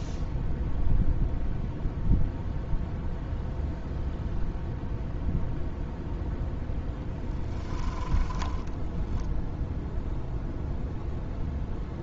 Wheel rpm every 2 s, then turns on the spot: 0, 0, 0, 0, 10, 0.
8-10